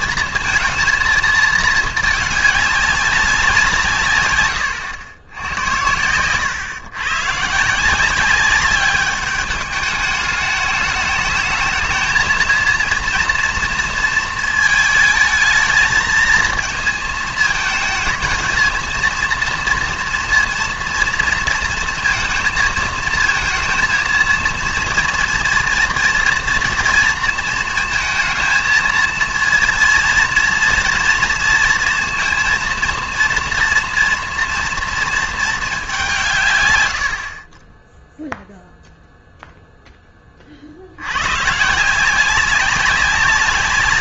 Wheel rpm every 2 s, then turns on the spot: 230, 210, 110, 120, 200, 210, 230, 220, 230, 220, 230, 230, 230, 230, 230, 230, 230, 230, 130, 0, 50, 190.
none